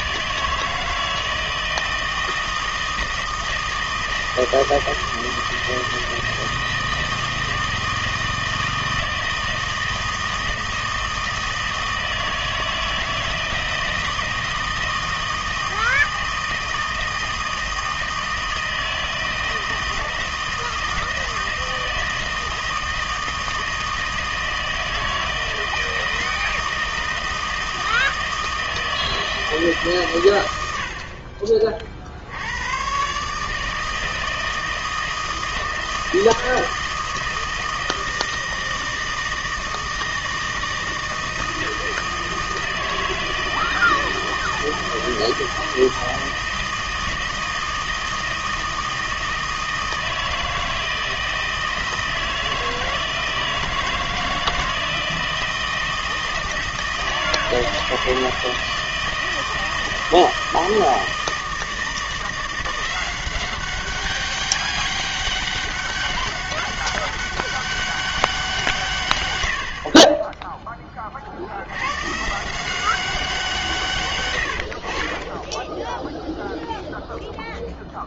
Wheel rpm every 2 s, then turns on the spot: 160, 160, 160, 160, 160, 160, 160, 160, 160, 160, 160, 160, 160, 160, 160, 90, 90, 160, 160, 160, 160, 160, 160, 160, 160, 160, 160, 160, 160, 160, 160, 170, 200, 200, 180, 10, 170, 90, 0.
none